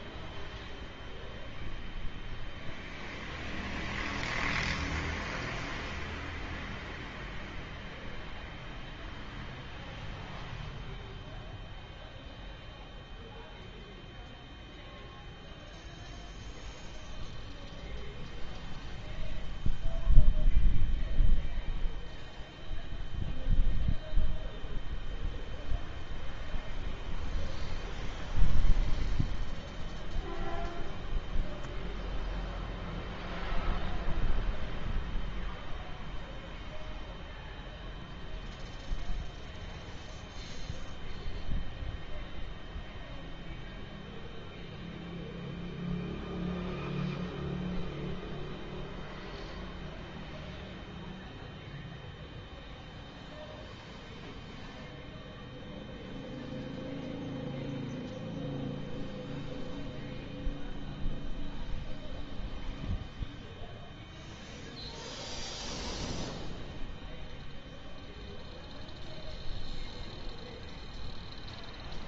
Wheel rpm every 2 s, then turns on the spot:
0, 0, 0, 0, 0, 0, 0, 0, 0, 0, 0, 0, 0, 0, 0, 0, 0, 0, 0, 0, 0, 0, 0, 0, 0, 0, 0, 0, 0, 0, 0, 0, 0, 0, 0, 0.
none